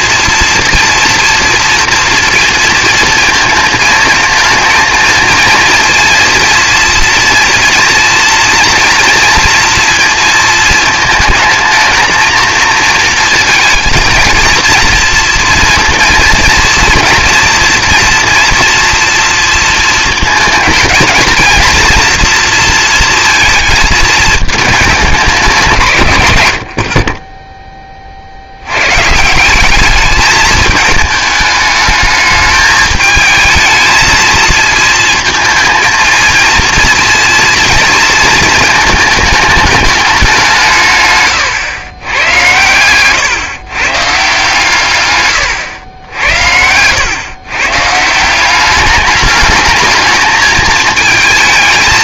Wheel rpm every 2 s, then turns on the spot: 230, 230, 230, 230, 230, 220, 230, 230, 230, 230, 230, 230, 210, 70, 110, 210, 210, 230, 230, 220, 170, 110, 130, 100, 200, 220.
none